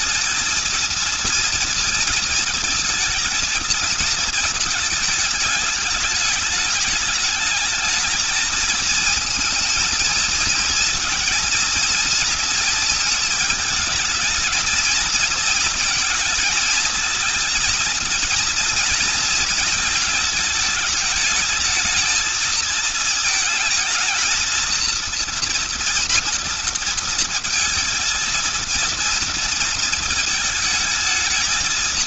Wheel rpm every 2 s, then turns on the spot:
220, 220, 220, 210, 220, 230, 230, 220, 230, 230, 220, 220, 230, 230, 230, 220.
none